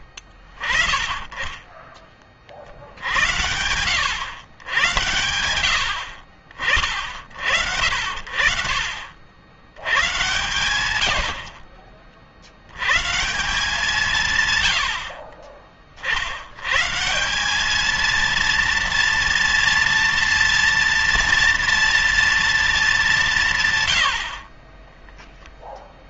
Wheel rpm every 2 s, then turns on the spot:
20, 60, 100, 40, 60, 110, 100, 90, 130, 230, 230, 210, 20.
24-26